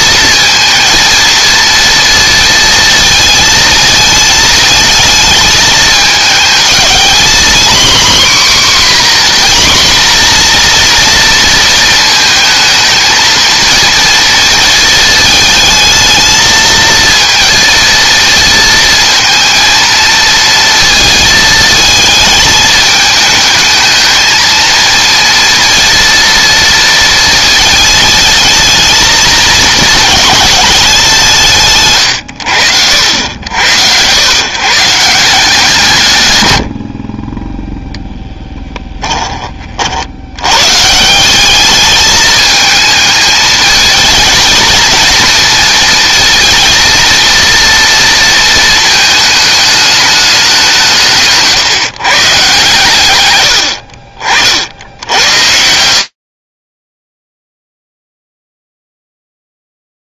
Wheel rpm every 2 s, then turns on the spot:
230, 220, 220, 230, 260, 230, 220, 220, 220, 220, 220, 220, 230, 230, 220, 190, 90, 160, 50, 10, 150, 220, 230, 230, 220, 180, 120, 70, 40, 0.
none